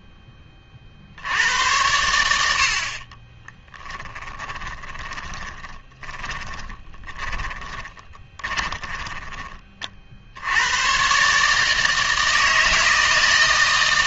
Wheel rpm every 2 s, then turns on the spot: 30, 70, 20, 20, 20, 110, 160.
4-10